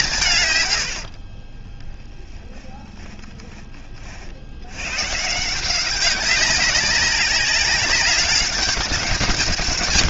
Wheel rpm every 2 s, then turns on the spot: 150, 20, 60, 190, 200.
2-4